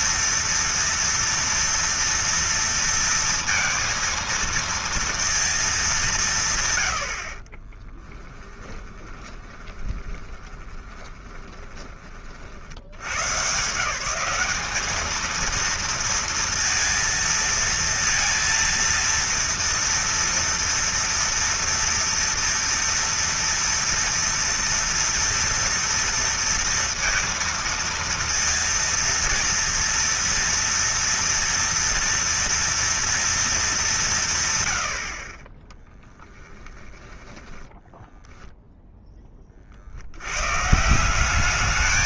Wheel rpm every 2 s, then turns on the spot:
230, 230, 230, 90, 20, 20, 80, 210, 230, 230, 230, 240, 230, 230, 230, 230, 230, 70, 10, 10, 170.
8-12 36-38